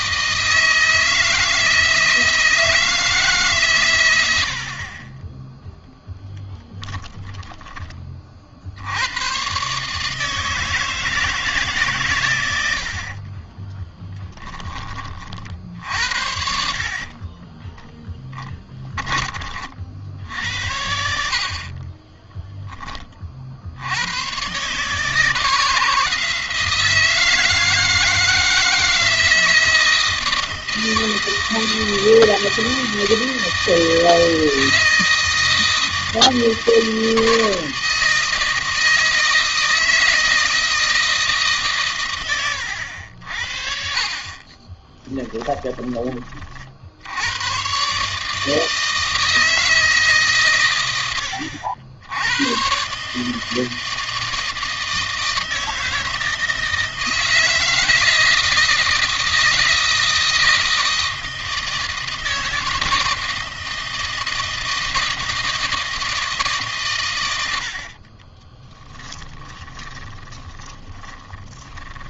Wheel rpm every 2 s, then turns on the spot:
160, 160, 30, 10, 80, 160, 80, 20, 50, 20, 70, 20, 140, 160, 160, 160, 160, 160, 160, 160, 160, 70, 20, 60, 160, 110, 140, 160, 160, 160, 160, 160, 160, 120, 20, 20.
6-8 12-14 16-18 44-46 68-72